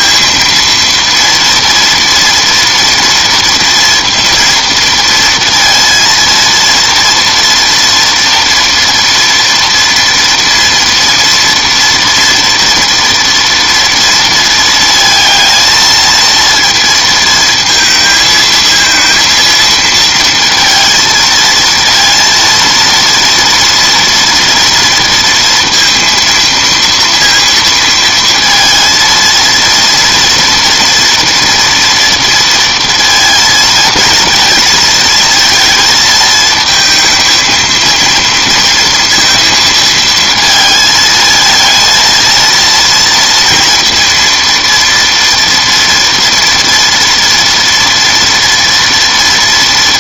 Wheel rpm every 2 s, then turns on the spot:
230, 230, 230, 230, 230, 230, 240, 230, 230, 220, 230, 230, 230, 230, 230, 230, 230, 220, 220, 230, 230, 230, 230, 240, 230.
none